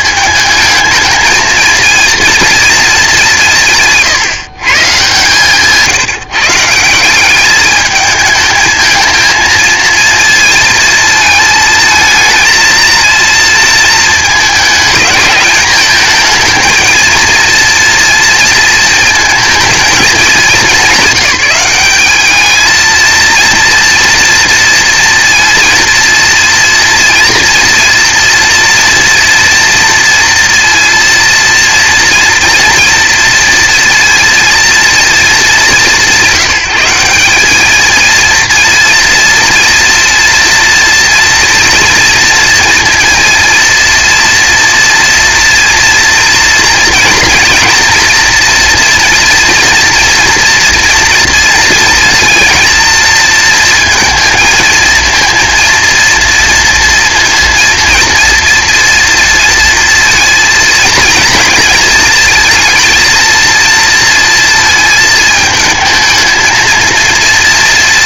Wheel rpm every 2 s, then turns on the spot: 220, 230, 140, 150, 220, 230, 230, 210, 230, 230, 200, 210, 230, 230, 230, 230, 230, 230, 180, 230, 230, 240, 230, 240, 230, 230, 230, 230, 230, 230, 230, 230, 230, 220.
none